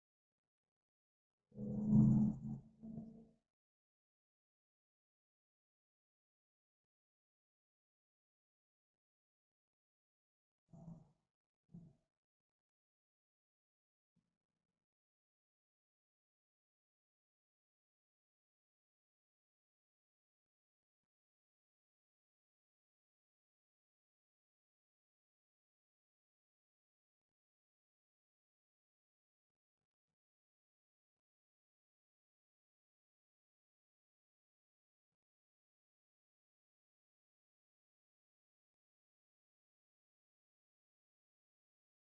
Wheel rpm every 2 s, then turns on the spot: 0, 0, 0, 0, 0, 0, 0, 0, 0, 0, 0, 0, 0, 0, 0, 0, 0, 0, 0, 0, 0.
none